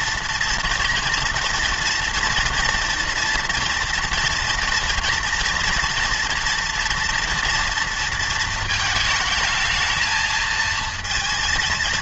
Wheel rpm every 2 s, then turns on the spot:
230, 230, 230, 230, 220, 220.
none